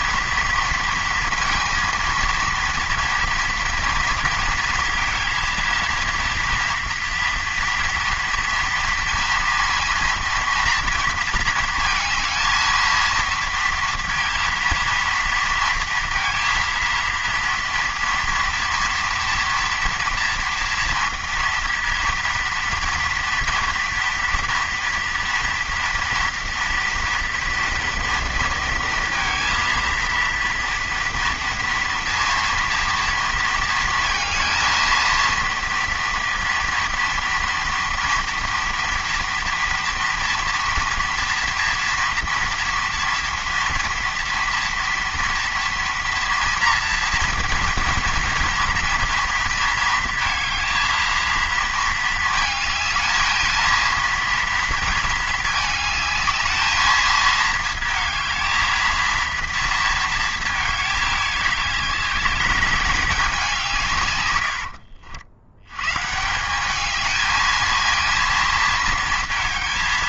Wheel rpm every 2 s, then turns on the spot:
230, 230, 230, 230, 230, 230, 230, 230, 230, 230, 230, 230, 240, 230, 230, 230, 230, 220, 230, 230, 240, 230, 230, 230, 230, 230, 220, 230, 220, 230, 220, 200, 80, 190, 230.
64-66